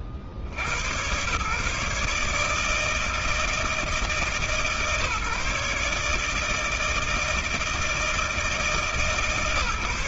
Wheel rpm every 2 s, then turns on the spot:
70, 150, 150, 150, 160.
none